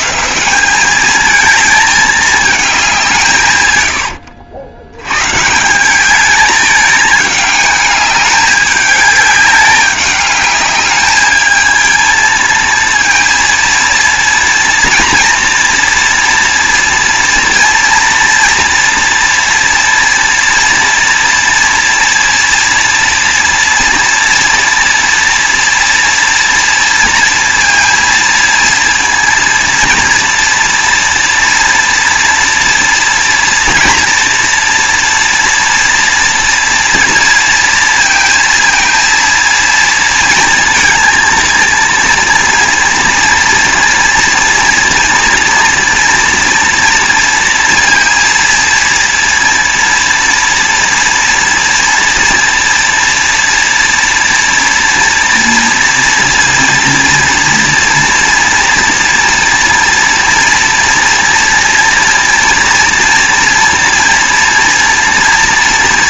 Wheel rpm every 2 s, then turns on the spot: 180, 210, 100, 210, 210, 210, 230, 230, 230, 230, 230, 230, 240, 230, 230, 230, 240, 240, 230, 230, 230, 230, 230, 230, 230, 230, 230, 230, 230, 230, 230, 240, 240.
none